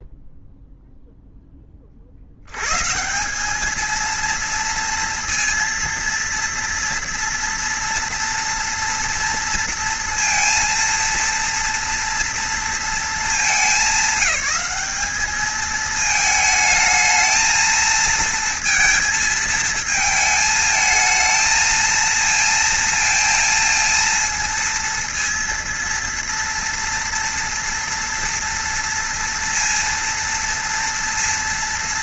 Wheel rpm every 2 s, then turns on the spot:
0, 160, 230, 230, 230, 230, 220, 210, 220, 230, 220, 230, 230, 230, 230, 230.
none